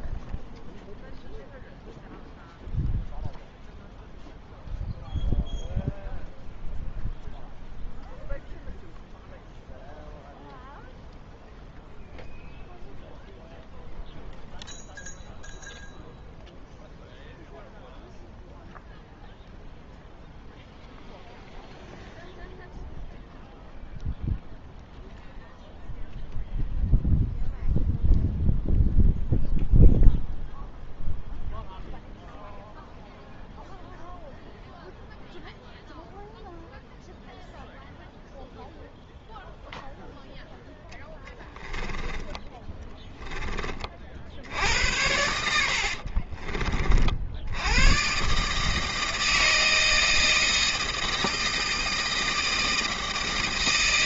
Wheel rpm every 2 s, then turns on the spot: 0, 0, 0, 0, 0, 0, 0, 0, 0, 0, 0, 0, 0, 0, 0, 0, 0, 0, 0, 0, 0, 30, 70, 30, 150, 160, 160.
42-44